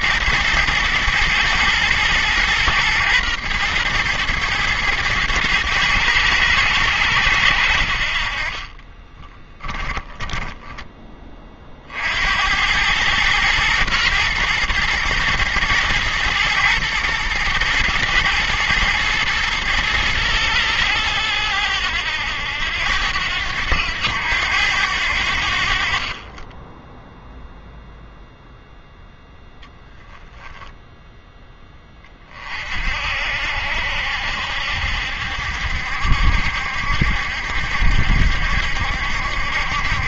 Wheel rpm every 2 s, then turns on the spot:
110, 120, 110, 100, 30, 10, 90, 110, 120, 120, 110, 90, 90, 20, 0, 0, 40, 70, 70, 70.
8-12